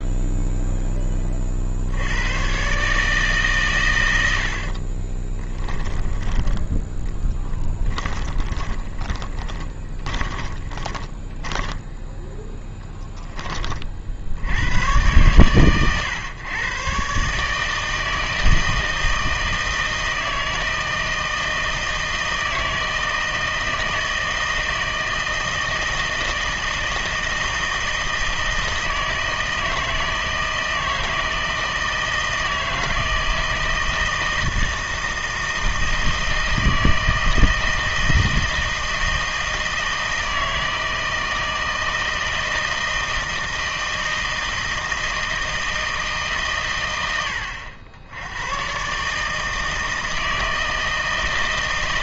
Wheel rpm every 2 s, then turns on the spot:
0, 130, 50, 10, 10, 20, 10, 100, 120, 160, 160, 160, 160, 160, 160, 160, 160, 160, 160, 160, 160, 160, 160, 110, 120, 160.
4-6 8-14